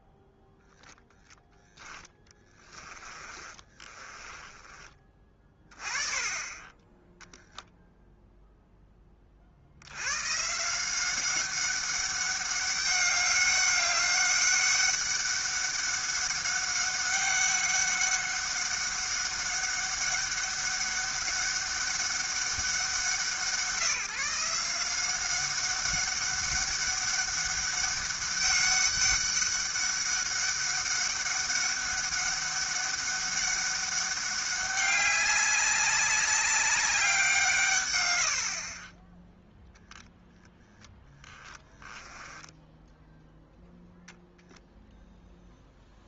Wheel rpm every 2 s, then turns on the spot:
0, 30, 30, 30, 0, 170, 200, 200, 200, 200, 200, 180, 170, 200, 200, 200, 200, 200, 200, 40, 0, 10, 0.
2-4 38-40 42-44